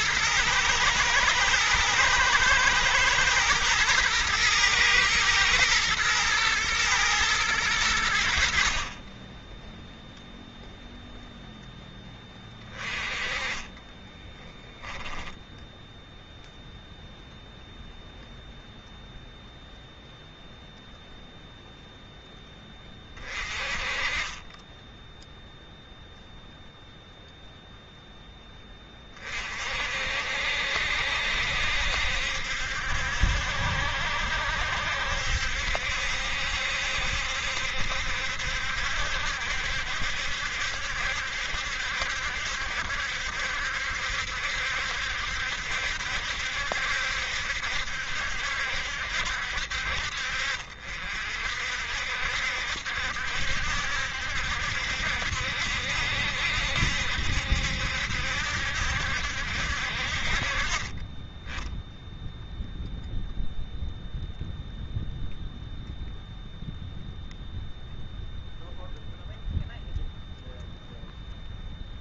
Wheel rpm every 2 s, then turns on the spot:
110, 120, 110, 110, 60, 0, 20, 20, 0, 0, 0, 20, 10, 0, 10, 60, 70, 70, 70, 70, 70, 70, 70, 70, 70, 60, 70, 70, 70, 70, 30, 0, 0, 0, 0, 0.
12-16